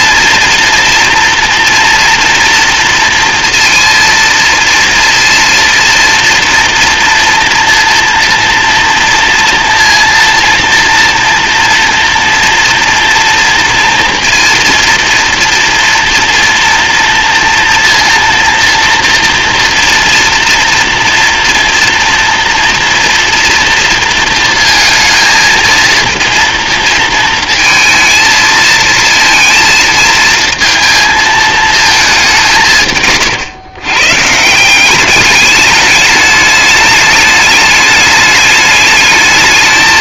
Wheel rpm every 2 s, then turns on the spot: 230, 230, 230, 230, 240, 230, 230, 230, 230, 230, 230, 230, 230, 230, 230, 230, 150, 180, 210, 210.
none